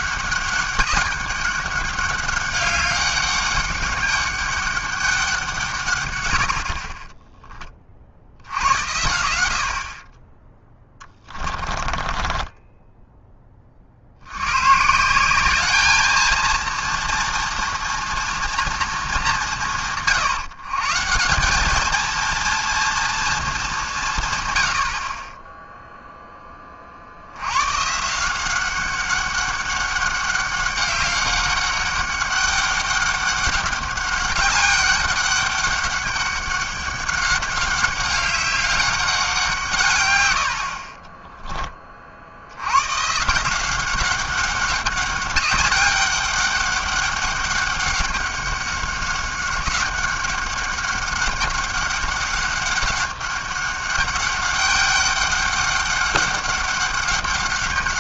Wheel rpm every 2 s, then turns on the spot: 190, 200, 200, 70, 80, 10, 20, 110, 230, 230, 150, 230, 110, 20, 180, 190, 200, 200, 200, 190, 80, 90, 200, 200, 200, 200, 200, 200, 200.
12-14